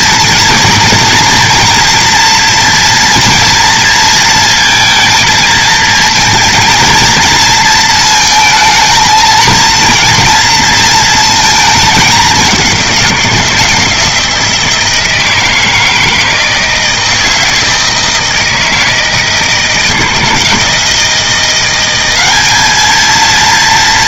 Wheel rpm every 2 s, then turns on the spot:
230, 230, 230, 230, 220, 230, 190, 170, 160, 160, 170, 210.
none